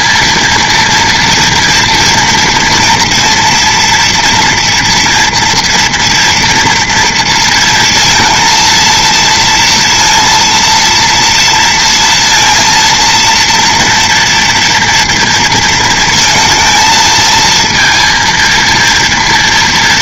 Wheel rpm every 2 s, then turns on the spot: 240, 230, 230, 240, 230, 230, 230, 230, 230, 230.
none